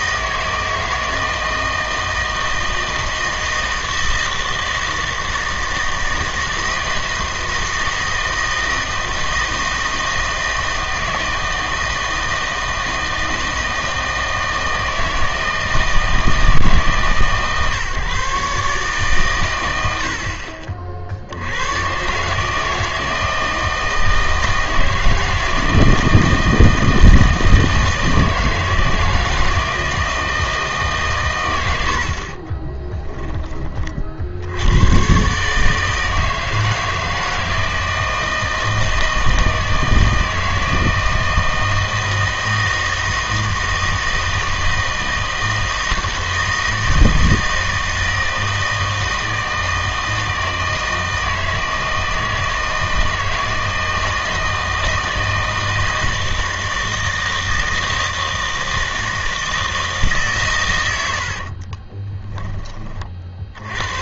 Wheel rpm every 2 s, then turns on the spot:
160, 160, 160, 160, 160, 160, 160, 160, 160, 150, 50, 160, 160, 160, 160, 150, 20, 90, 160, 160, 160, 160, 160, 160, 160, 160, 160, 160, 160, 160, 100, 20.
32-34